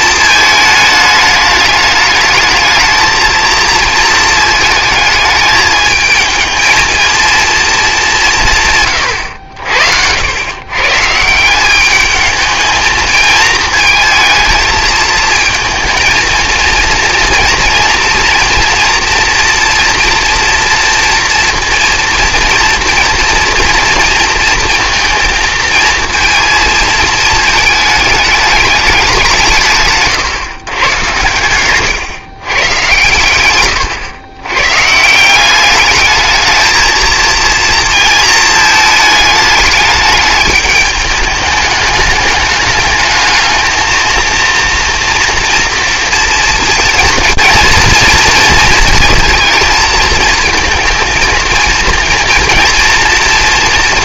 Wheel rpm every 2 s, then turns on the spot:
220, 220, 220, 220, 130, 130, 220, 220, 230, 230, 240, 240, 230, 230, 200, 120, 120, 130, 220, 220, 210, 210, 230, 230, 220, 230, 230.
none